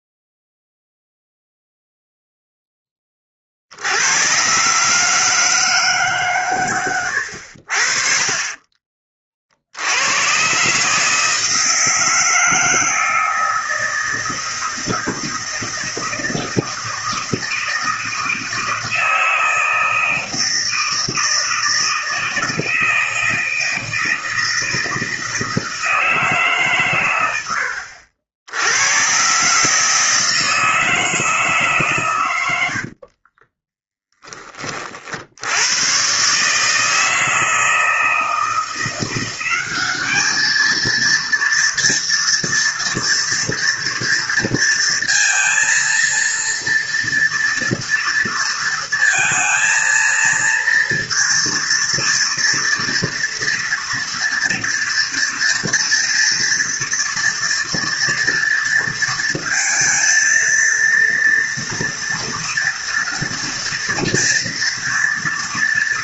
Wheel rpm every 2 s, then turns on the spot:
0, 10, 120, 120, 30, 130, 160, 160, 160, 160, 160, 160, 160, 140, 90, 160, 90, 30, 150, 170, 220, 240, 230, 230, 230, 230, 230, 230, 230, 230, 230, 230, 230.
32-34